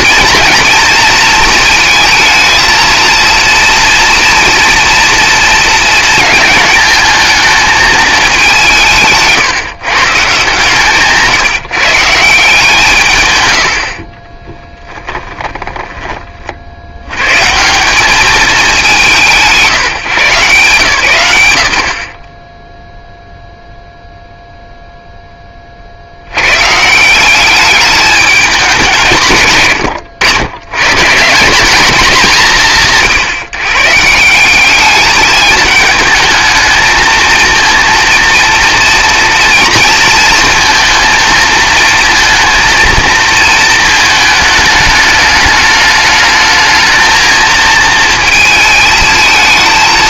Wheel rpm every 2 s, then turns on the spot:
230, 230, 230, 220, 180, 140, 150, 20, 60, 200, 120, 0, 0, 130, 190, 110, 170, 200, 220, 230, 230, 230, 210, 220, 220.
14-16